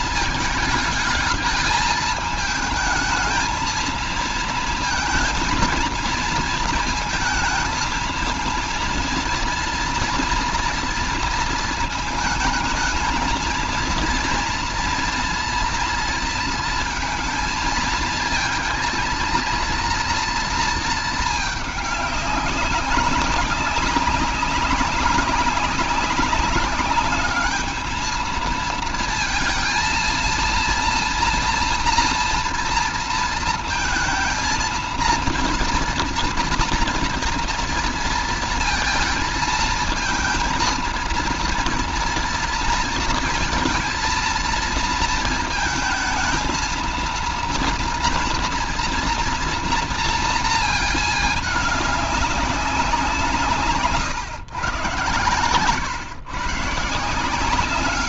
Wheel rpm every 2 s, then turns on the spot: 220, 220, 220, 220, 230, 230, 220, 230, 230, 220, 230, 190, 190, 200, 220, 230, 230, 230, 230, 230, 230, 230, 220, 230, 230, 230, 190, 130, 150.
none